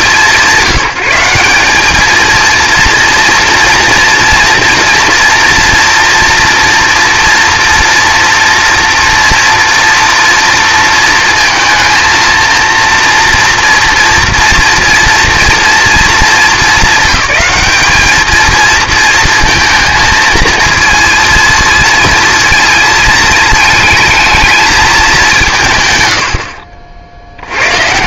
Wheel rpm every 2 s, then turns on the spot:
180, 230, 230, 230, 240, 230, 230, 230, 220, 230, 230, 220, 220, 60.
none